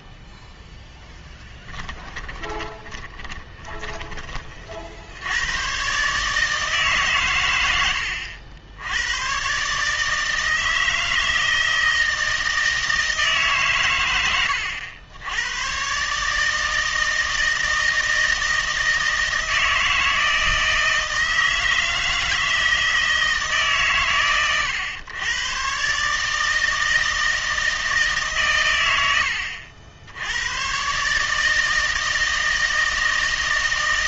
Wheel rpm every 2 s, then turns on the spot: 0, 20, 50, 150, 80, 160, 160, 90, 160, 160, 160, 160, 120, 160, 100, 120, 160.
2-4